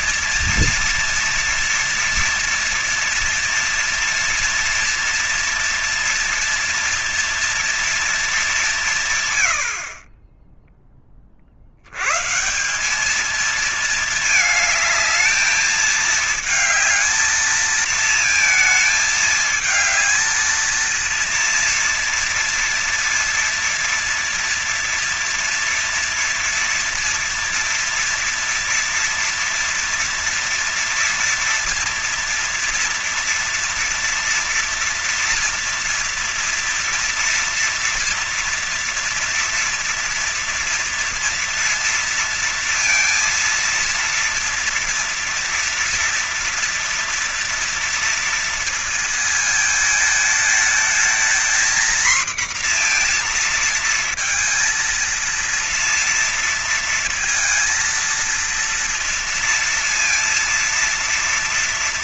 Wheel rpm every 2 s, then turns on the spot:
240, 240, 230, 230, 160, 20, 180, 220, 220, 220, 230, 230, 230, 240, 230, 240, 230, 230, 230, 230, 230, 230, 230, 230, 220, 220, 230, 230, 230, 230, 230.
none